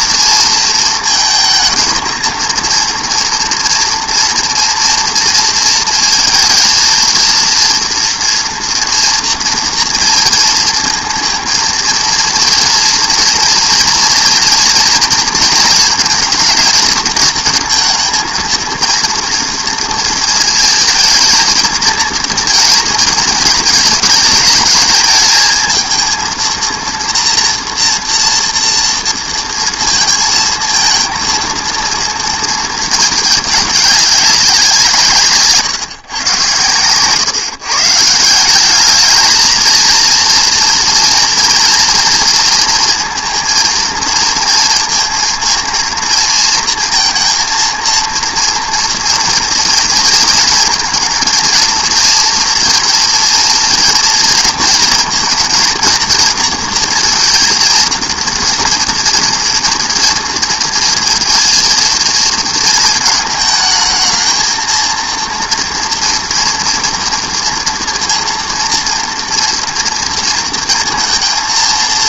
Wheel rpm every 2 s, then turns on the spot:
230, 230, 230, 220, 230, 230, 230, 230, 230, 230, 220, 230, 220, 230, 230, 230, 230, 180, 130, 190, 230, 230, 230, 230, 230, 230, 230, 230, 230, 230, 230, 220, 230, 230, 230, 230.
none